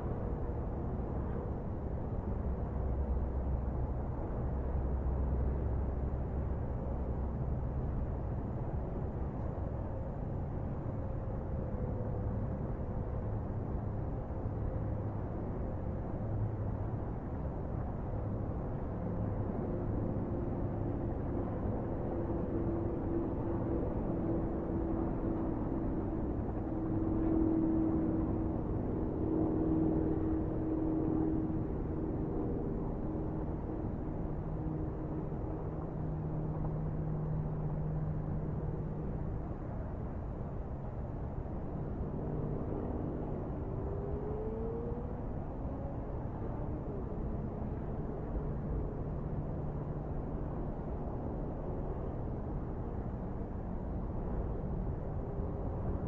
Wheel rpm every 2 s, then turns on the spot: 0, 0, 0, 0, 0, 0, 0, 0, 0, 0, 0, 0, 0, 0, 0, 0, 0, 0, 0, 0, 0, 0, 0, 0, 0, 0, 0, 0.
none